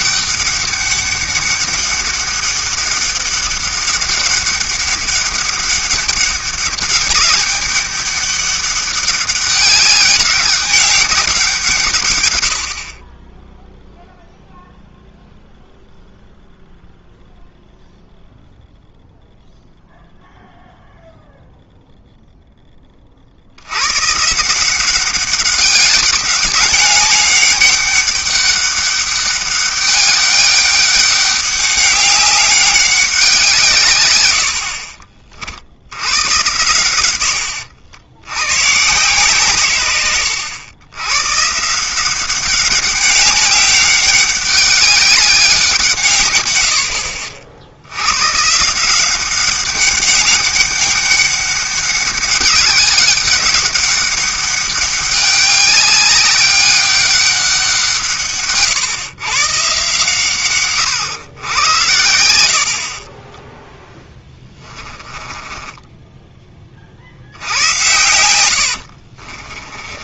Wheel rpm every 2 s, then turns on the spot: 190, 200, 200, 200, 200, 200, 70, 0, 0, 0, 0, 10, 170, 200, 200, 200, 200, 60, 110, 110, 100, 200, 200, 80, 150, 190, 200, 200, 200, 130, 130, 60, 20, 30, 80.
64-66 68-70